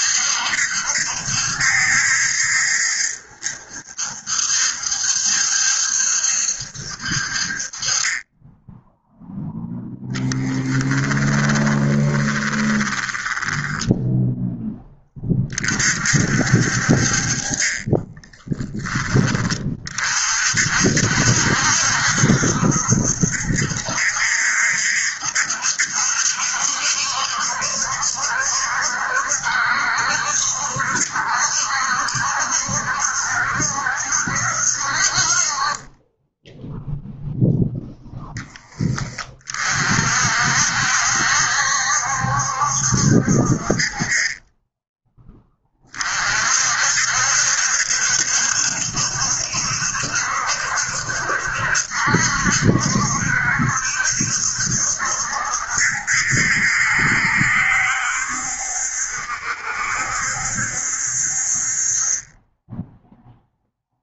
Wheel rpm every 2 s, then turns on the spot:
70, 70, 70, 60, 0, 10, 20, 10, 50, 20, 60, 70, 70, 70, 70, 70, 70, 60, 0, 20, 70, 70, 20, 60, 70, 70, 70, 70, 70, 70, 60, 10.
10-14